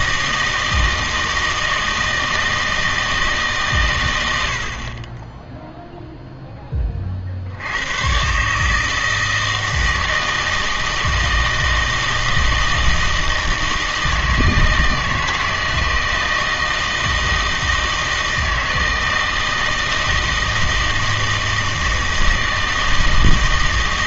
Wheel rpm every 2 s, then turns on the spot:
160, 160, 60, 10, 140, 160, 160, 160, 160, 160, 160, 160.
4-6